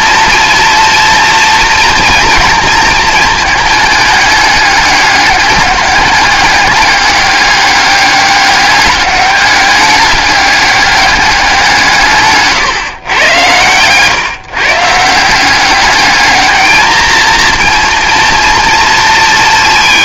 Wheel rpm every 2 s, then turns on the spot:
230, 230, 210, 210, 200, 200, 150, 150, 220, 230.
none